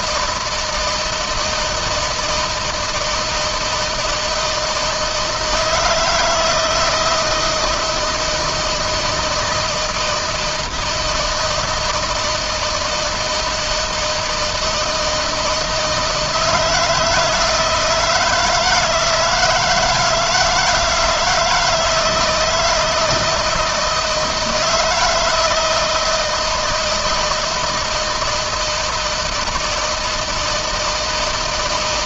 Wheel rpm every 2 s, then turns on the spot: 160, 160, 160, 160, 160, 160, 160, 160, 160, 170, 160, 160, 160, 160, 160, 160.
none